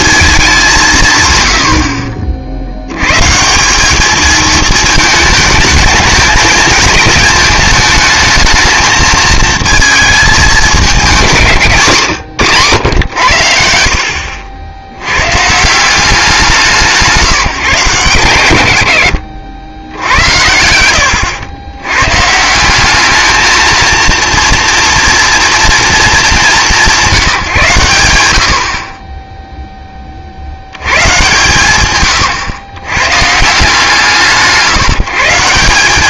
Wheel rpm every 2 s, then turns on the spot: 180, 70, 220, 220, 220, 200, 110, 90, 170, 90, 90, 180, 230, 190, 60, 80, 120, 160.
none